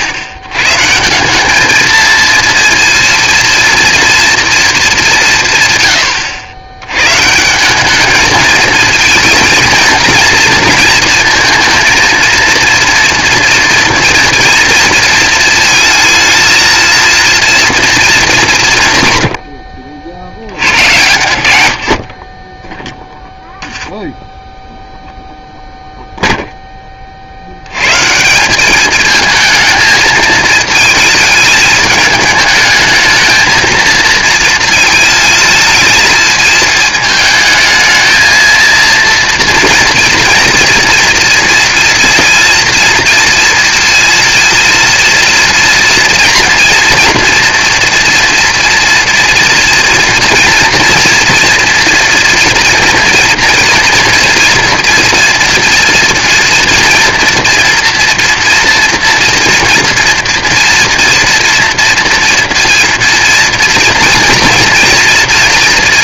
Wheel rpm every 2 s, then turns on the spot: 120, 230, 220, 110, 220, 230, 230, 230, 230, 170, 100, 20, 0, 10, 200, 220, 220, 230, 220, 230, 230, 230, 230, 240, 240, 230, 230, 230, 230, 230, 230, 230, 240.
none